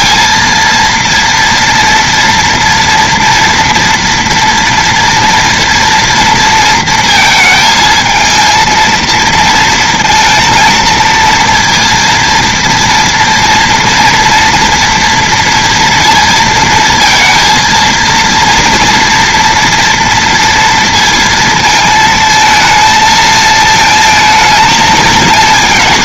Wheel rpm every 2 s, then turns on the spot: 230, 230, 230, 230, 220, 230, 230, 230, 230, 230, 230, 220, 220.
none